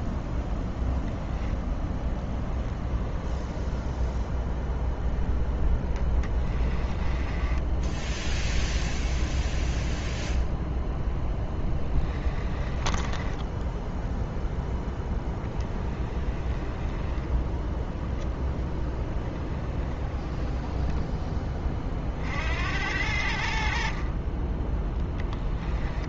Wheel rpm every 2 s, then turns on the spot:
0, 10, 10, 20, 0, 0, 30, 0, 20, 10, 10, 50, 20.
6-8 12-14